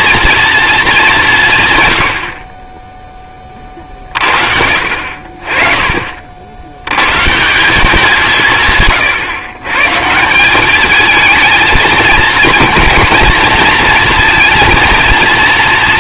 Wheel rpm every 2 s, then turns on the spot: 240, 90, 50, 70, 150, 180, 230, 230.
none